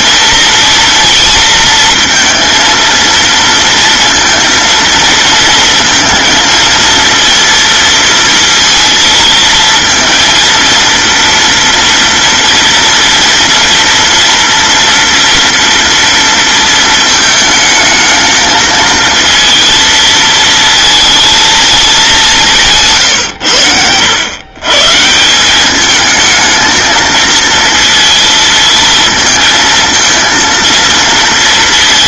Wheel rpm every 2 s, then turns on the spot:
230, 230, 230, 230, 230, 230, 230, 230, 230, 220, 220, 170, 130, 220, 220, 230.
none